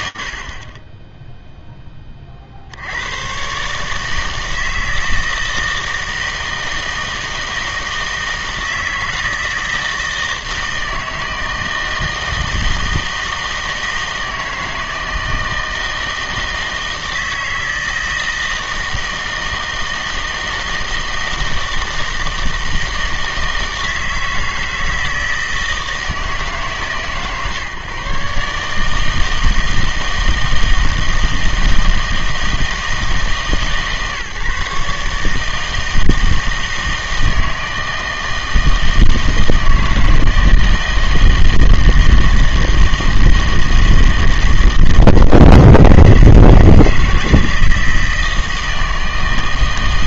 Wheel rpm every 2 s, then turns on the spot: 30, 70, 160, 160, 160, 160, 160, 160, 160, 160, 160, 160, 160, 140, 150, 160, 160, 150, 160, 160, 160, 160, 160, 160, 160.
none